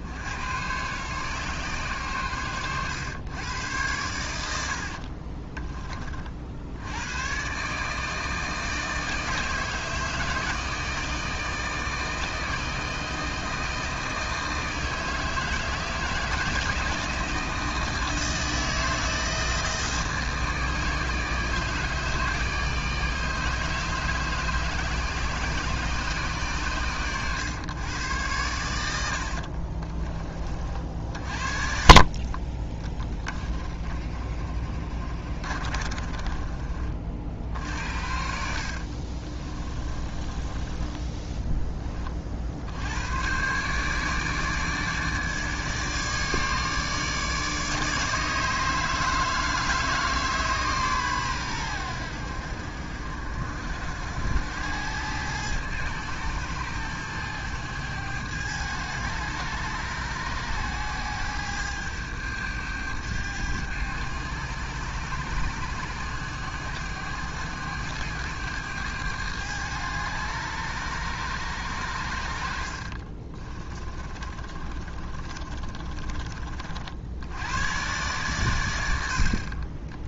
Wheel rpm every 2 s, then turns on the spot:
110, 110, 60, 80, 160, 160, 160, 160, 160, 160, 160, 150, 140, 120, 90, 50, 10, 30, 40, 50, 20, 90, 150, 150, 160, 140, 60, 100, 110, 100, 100, 100, 100, 100, 100, 100, 60, 30, 50, 100.
4-6 28-30 34-36 38-42 72-76